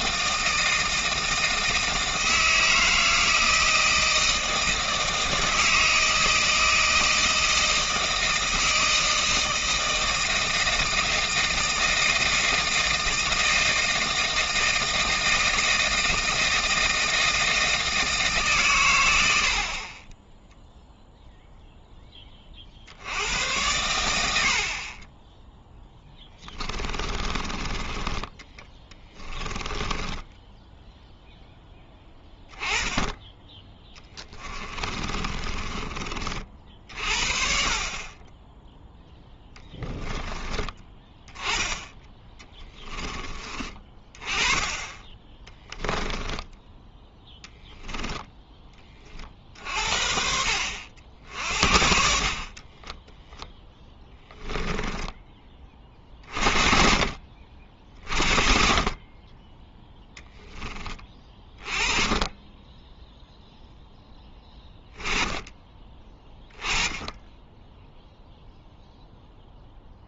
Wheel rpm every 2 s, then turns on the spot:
160, 160, 160, 160, 160, 160, 160, 160, 160, 110, 0, 60, 50, 20, 10, 0, 10, 30, 50, 0, 30, 20, 20, 10, 20, 60, 20, 10, 40, 30, 20, 10, 10, 10, 0.
26-30 34-36 52-56